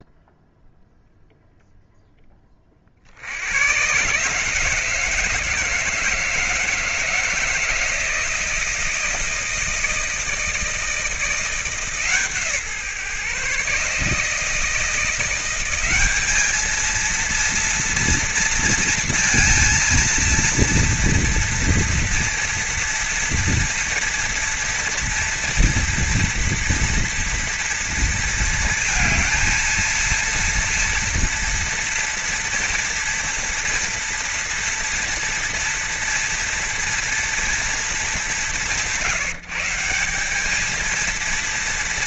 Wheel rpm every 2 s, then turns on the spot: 0, 30, 150, 160, 160, 160, 150, 170, 220, 230, 230, 230, 230, 230, 230, 230, 230, 230, 240, 160, 210.
none